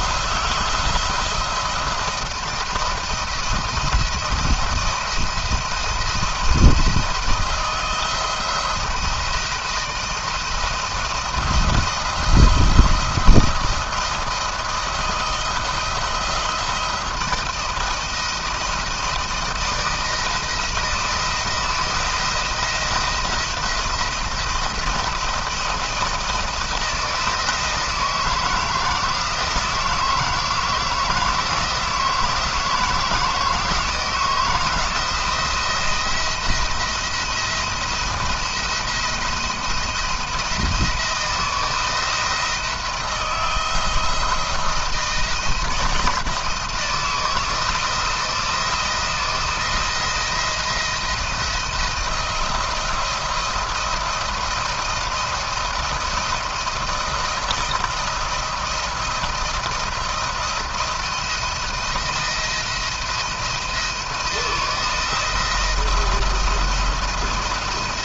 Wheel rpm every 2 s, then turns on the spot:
170, 170, 170, 170, 170, 170, 170, 170, 170, 170, 160, 160, 170, 170, 160, 160, 160, 160, 170, 170, 170, 170, 170, 160, 160, 170, 170, 170, 170, 170, 170, 160, 170, 170.
none